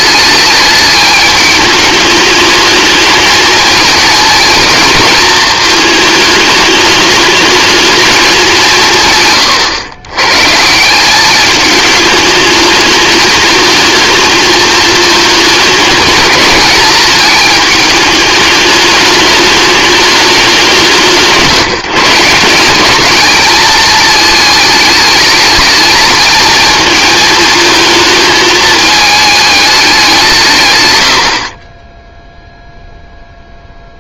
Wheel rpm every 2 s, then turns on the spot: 210, 210, 220, 210, 180, 150, 220, 220, 220, 210, 210, 190, 220, 220, 220, 130, 0.
none